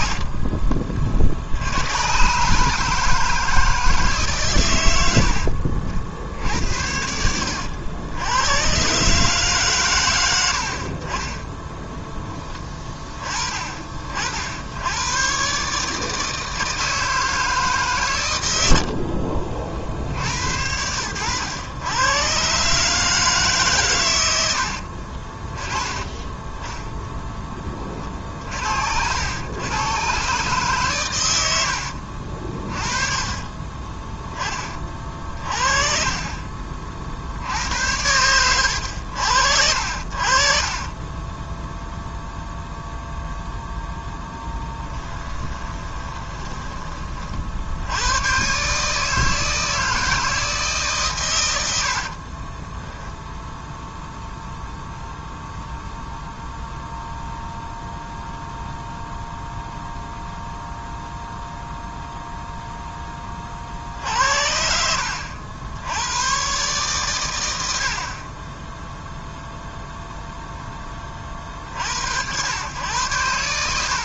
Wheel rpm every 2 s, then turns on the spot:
50, 160, 90, 80, 130, 40, 20, 100, 160, 70, 90, 150, 60, 0, 70, 120, 30, 40, 50, 80, 20, 0, 10, 30, 150, 140, 10, 0, 0, 0, 0, 20, 70, 130, 0, 20, 100.
6-8 18-22 24-26 32-36 40-42 44-46 52-54